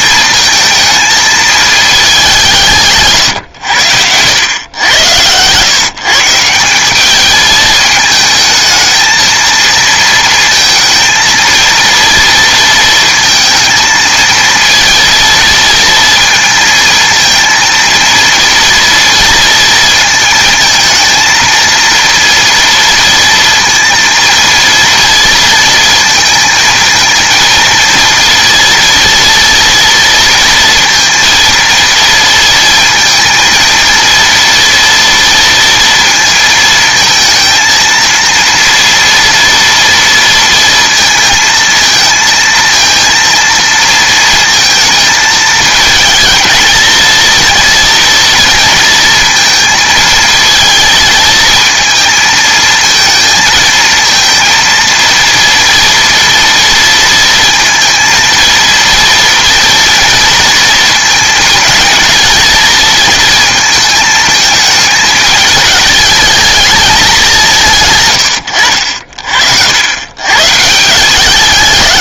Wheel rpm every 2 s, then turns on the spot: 220, 160, 100, 180, 220, 230, 230, 230, 230, 240, 230, 230, 230, 230, 230, 230, 230, 230, 220, 230, 230, 230, 220, 230, 230, 220, 220, 230, 230, 230, 230, 230, 220, 210, 80, 160.
none